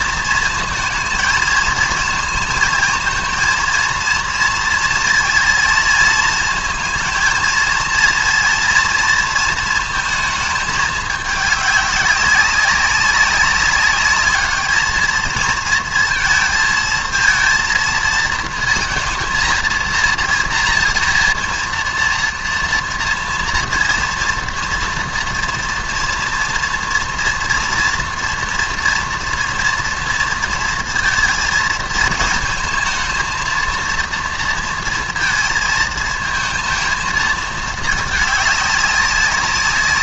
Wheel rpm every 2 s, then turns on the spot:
230, 220, 230, 230, 230, 220, 200, 210, 230, 230, 230, 240, 230, 230, 230, 230, 220, 230, 220, 210.
none